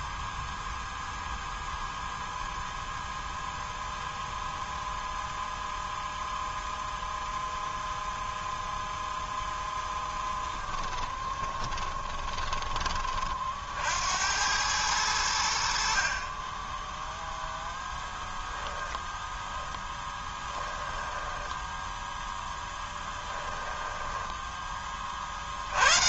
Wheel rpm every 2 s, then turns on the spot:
0, 0, 0, 0, 0, 10, 20, 100, 10, 10, 10, 10, 20.
10-12 20-24